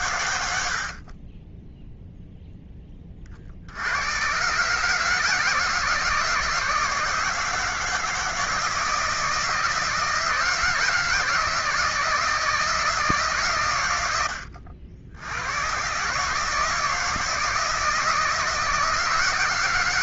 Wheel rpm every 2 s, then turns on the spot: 100, 0, 130, 160, 160, 160, 160, 100, 150, 170.
none